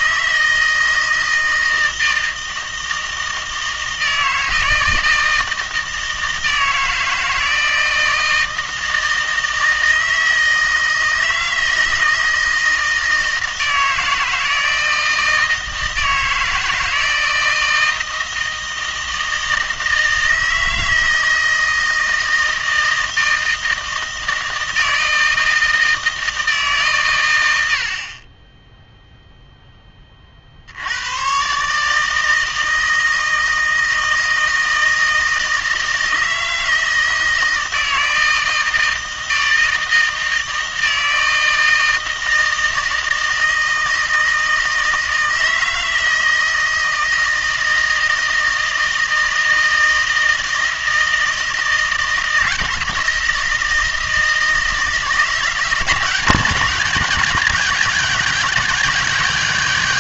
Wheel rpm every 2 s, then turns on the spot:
160, 160, 160, 160, 160, 160, 160, 160, 160, 160, 160, 160, 160, 150, 10, 60, 160, 160, 160, 160, 160, 160, 160, 160, 160, 160, 160, 160, 180, 160.
none